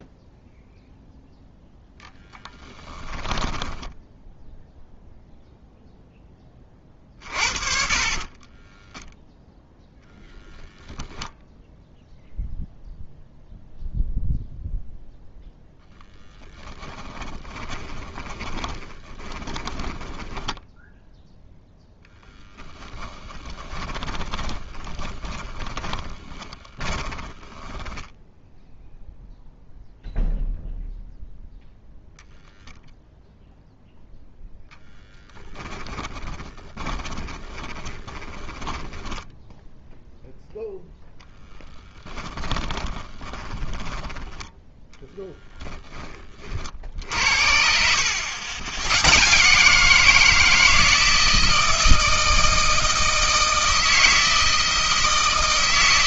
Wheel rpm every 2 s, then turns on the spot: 0, 10, 0, 30, 10, 0, 0, 0, 20, 20, 10, 10, 20, 30, 0, 0, 0, 10, 20, 10, 10, 20, 10, 50, 110, 160, 160, 160.
8-10 16-20 24-28 34-40 42-44